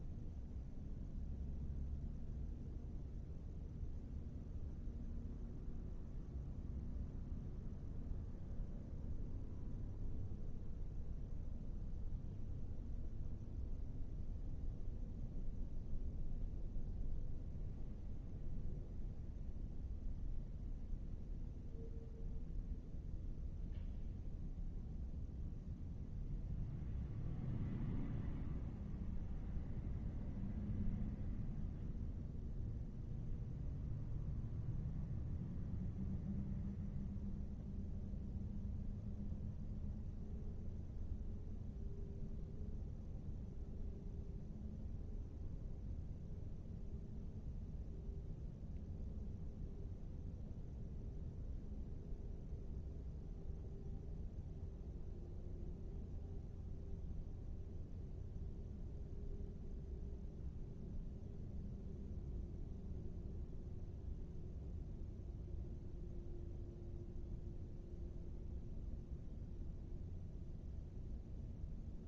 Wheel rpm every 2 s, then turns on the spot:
0, 0, 0, 0, 0, 0, 0, 0, 0, 0, 0, 0, 0, 0, 0, 0, 0, 0, 0, 0, 0, 0, 0, 0, 0, 0, 0, 0, 0, 0, 0, 0, 0, 0, 0, 0.
none